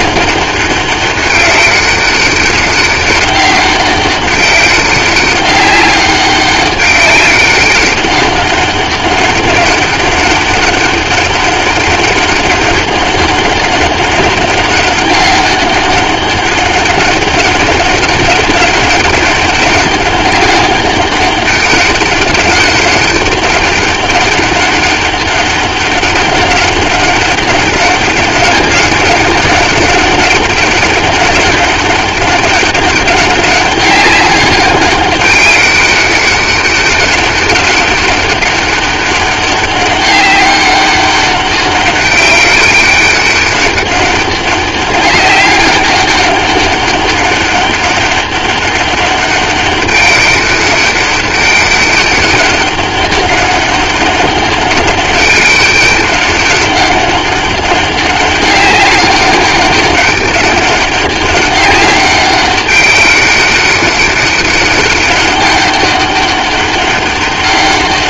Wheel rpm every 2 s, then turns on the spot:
200, 200, 200, 200, 190, 200, 200, 200, 200, 190, 200, 200, 200, 200, 200, 200, 200, 200, 200, 200, 190, 200, 200, 200, 200, 200, 200, 200, 200, 200, 200, 200, 200, 200.
none